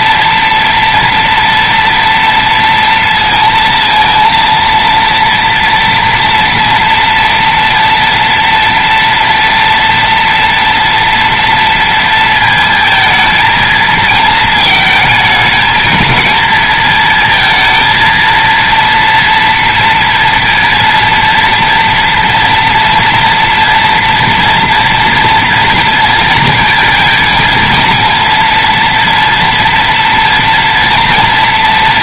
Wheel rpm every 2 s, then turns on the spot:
230, 230, 230, 230, 230, 230, 230, 230, 220, 230, 230, 240, 230, 230, 230, 230.
none